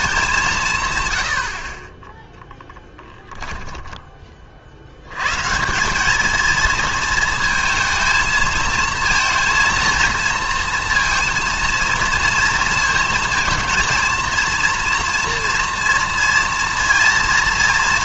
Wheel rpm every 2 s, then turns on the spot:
160, 10, 60, 230, 230, 230, 230, 230, 230.
none